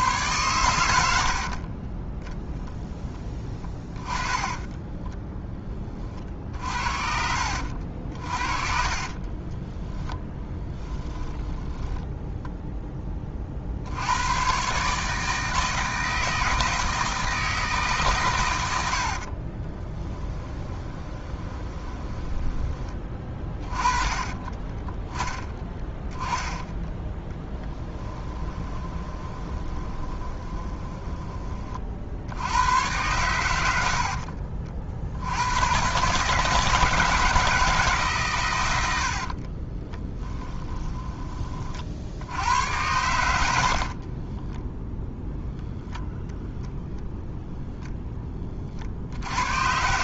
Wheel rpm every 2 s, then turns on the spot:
100, 10, 10, 50, 40, 20, 10, 140, 160, 80, 20, 20, 20, 20, 20, 20, 100, 60, 160, 100, 20, 90, 0, 0, 50.
4-6 8-12 18-22 24-32 38-42